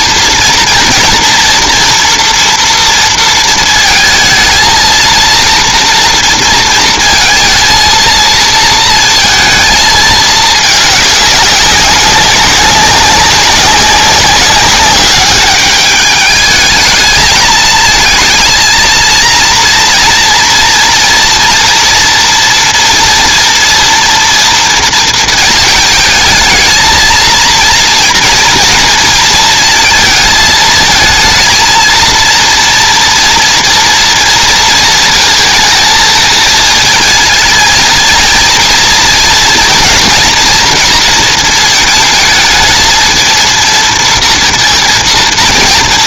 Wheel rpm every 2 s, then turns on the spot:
230, 230, 230, 230, 230, 210, 190, 200, 220, 230, 230, 230, 230, 220, 230, 230, 230, 230, 220, 230, 230, 220, 230.
none